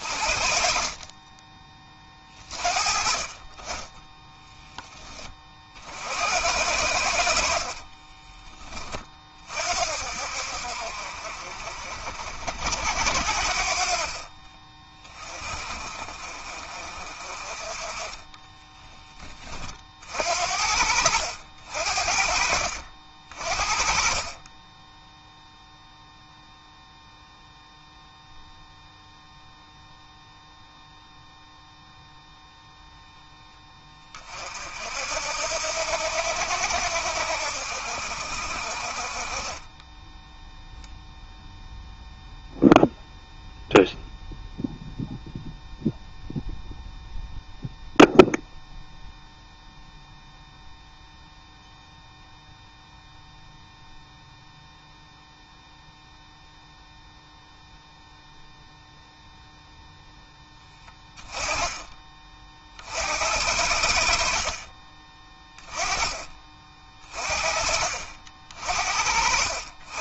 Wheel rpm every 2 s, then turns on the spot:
30, 40, 10, 70, 30, 50, 60, 30, 40, 20, 70, 50, 10, 0, 0, 0, 0, 60, 80, 40, 0, 0, 0, 0, 0, 0, 0, 0, 0, 0, 10, 60, 20, 30, 50.
60-62 64-66 68-70